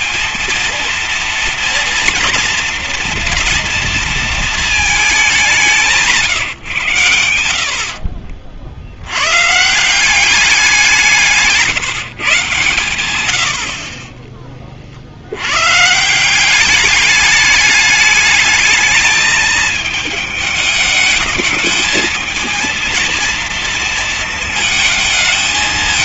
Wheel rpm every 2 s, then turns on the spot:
230, 230, 220, 140, 70, 190, 130, 30, 190, 220, 220, 230, 220.
none